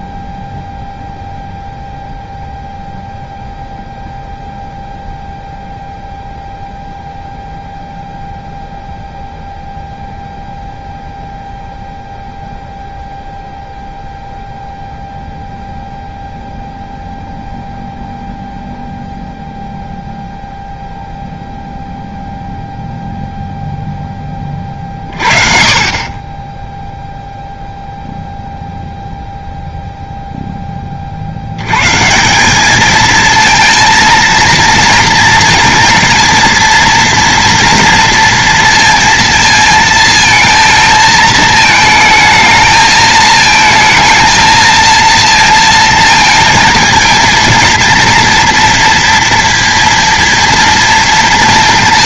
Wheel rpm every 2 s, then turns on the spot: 0, 0, 0, 0, 0, 0, 0, 0, 0, 0, 0, 0, 10, 20, 0, 0, 140, 230, 230, 230, 220, 220, 220, 230, 230, 240.
none